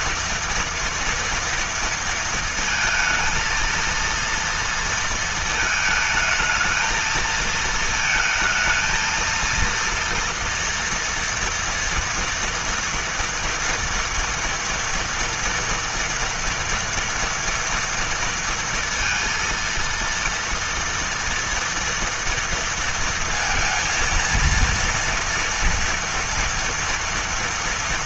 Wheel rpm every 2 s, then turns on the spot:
230, 230, 230, 220, 220, 230, 230, 230, 230, 230, 230, 230, 230, 230.
none